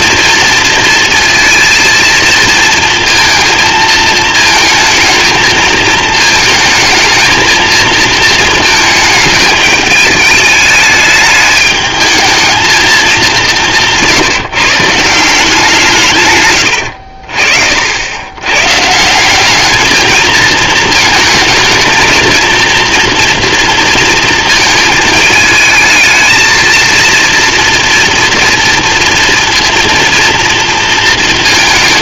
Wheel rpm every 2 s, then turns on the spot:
230, 230, 220, 230, 210, 210, 210, 170, 60, 180, 220, 230, 220, 230, 230, 230.
none